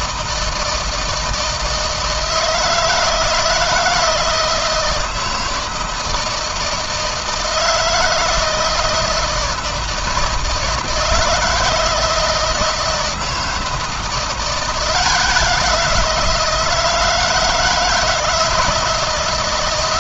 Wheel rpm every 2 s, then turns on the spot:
160, 160, 160, 160, 160, 160, 160, 170, 160, 160.
none